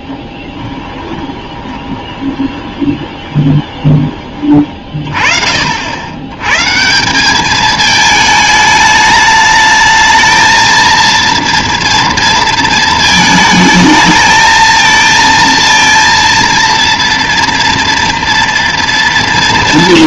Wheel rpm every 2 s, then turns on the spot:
10, 20, 30, 140, 210, 220, 220, 230, 230, 230.
0-4